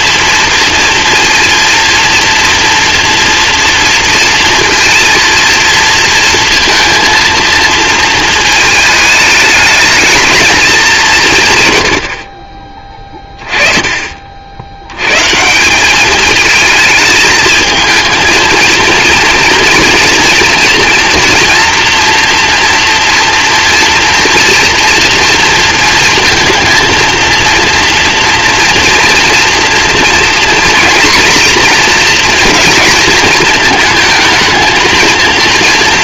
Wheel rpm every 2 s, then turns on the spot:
230, 230, 230, 230, 220, 220, 40, 70, 220, 230, 230, 240, 240, 230, 230, 240, 230, 220.
none